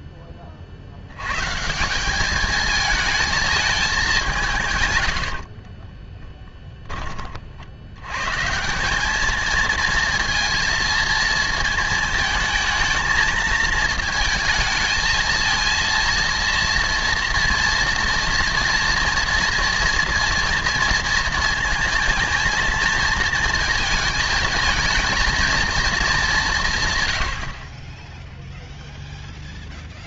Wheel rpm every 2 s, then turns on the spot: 40, 220, 150, 20, 180, 230, 220, 220, 230, 230, 230, 230, 220, 140, 0.
none